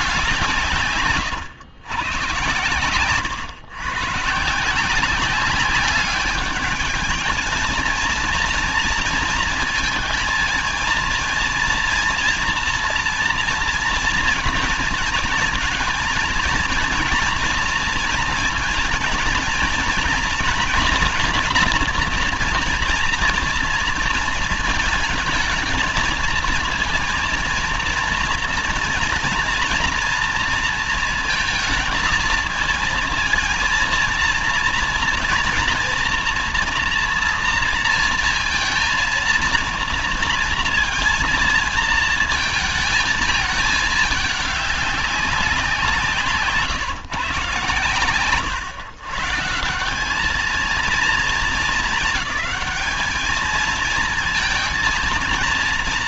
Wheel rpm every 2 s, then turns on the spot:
160, 120, 160, 210, 230, 230, 230, 230, 230, 230, 230, 240, 230, 220, 240, 230, 220, 230, 230, 230, 230, 220, 210, 160, 130, 220, 220, 230.
2-4